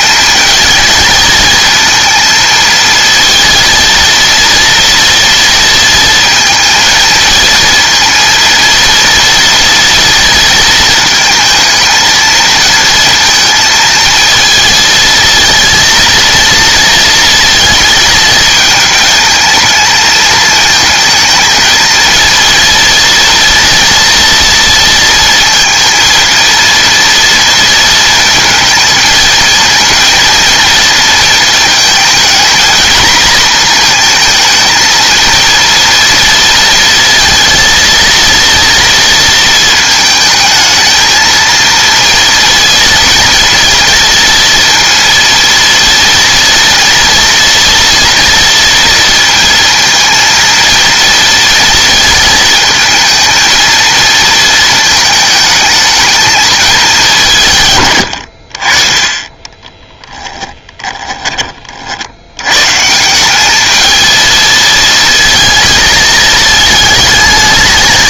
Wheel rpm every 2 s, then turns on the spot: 230, 230, 230, 230, 230, 230, 230, 230, 230, 220, 220, 230, 230, 230, 220, 230, 230, 220, 230, 230, 220, 230, 230, 230, 230, 230, 220, 220, 220, 50, 10, 130, 220, 220.
60-62